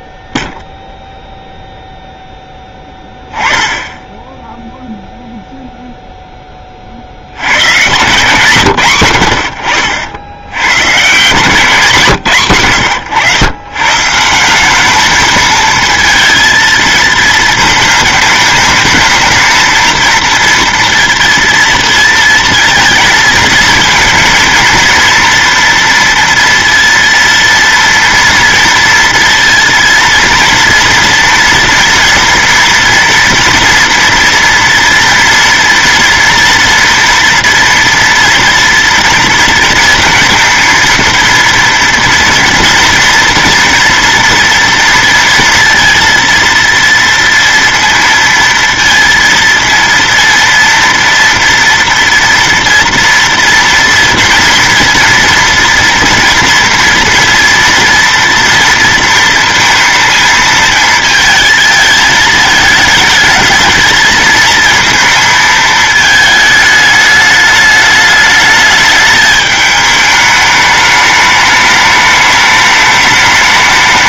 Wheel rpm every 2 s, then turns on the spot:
0, 10, 0, 30, 140, 100, 120, 180, 230, 220, 230, 230, 230, 230, 230, 230, 230, 230, 230, 230, 230, 230, 230, 230, 230, 230, 230, 240, 230, 230, 230, 220, 220, 210, 210, 210, 210.
none